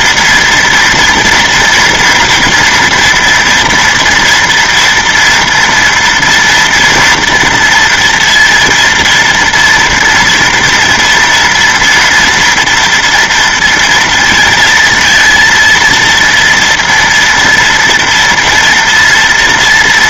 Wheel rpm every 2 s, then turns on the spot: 230, 240, 230, 230, 230, 230, 240, 230, 230, 230.
none